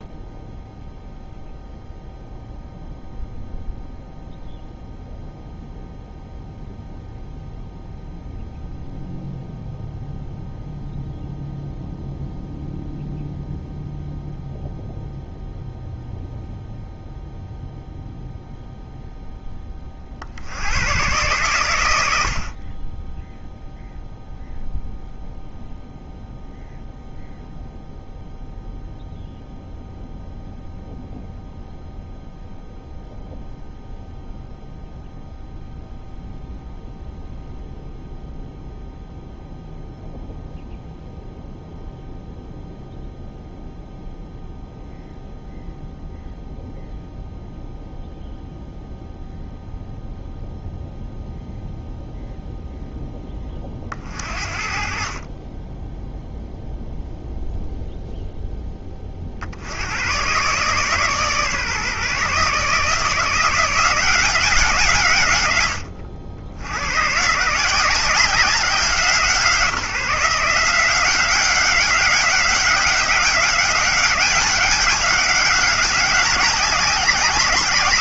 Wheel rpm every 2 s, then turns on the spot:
0, 0, 0, 0, 0, 0, 0, 0, 0, 0, 100, 20, 0, 0, 0, 0, 0, 0, 0, 0, 0, 0, 0, 0, 0, 0, 0, 50, 0, 20, 140, 160, 150, 110, 180, 170, 190, 200, 190.
none